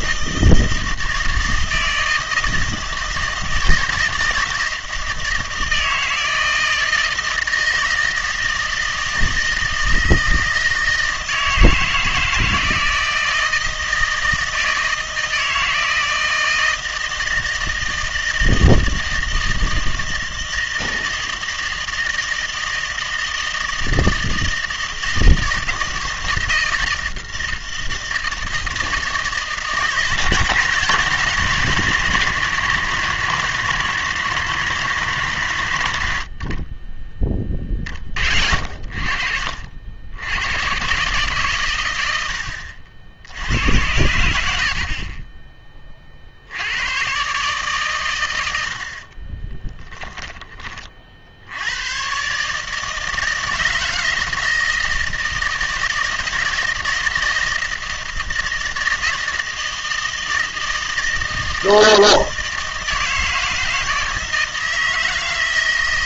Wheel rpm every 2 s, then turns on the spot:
160, 160, 160, 160, 160, 160, 160, 160, 160, 160, 160, 160, 160, 160, 160, 150, 120, 110, 30, 60, 110, 70, 60, 80, 90, 30, 150, 160, 160, 160, 160, 160, 160.
42-46